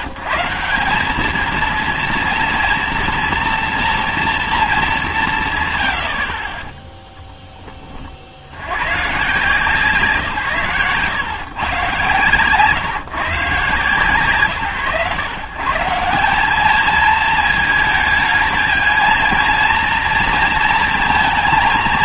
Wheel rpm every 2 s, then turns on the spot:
160, 230, 210, 10, 70, 130, 130, 140, 210, 220, 230.
none